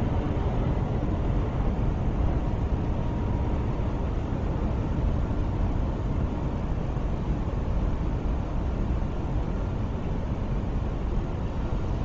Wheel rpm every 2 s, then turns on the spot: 0, 0, 0, 0, 0, 0.
none